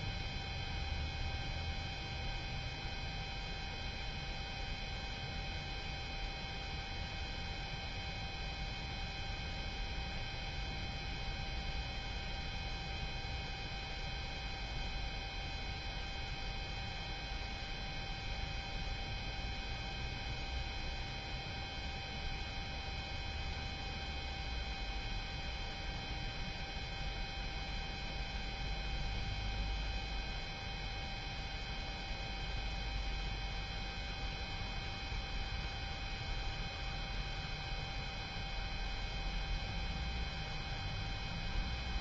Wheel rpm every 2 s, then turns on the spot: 0, 0, 0, 0, 0, 0, 0, 0, 0, 0, 0, 0, 0, 0, 0, 0, 0, 0, 0, 0, 0.
none